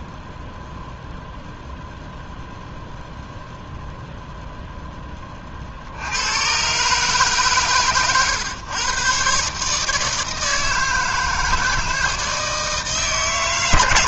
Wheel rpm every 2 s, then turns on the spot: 0, 0, 0, 130, 120, 160, 160.
none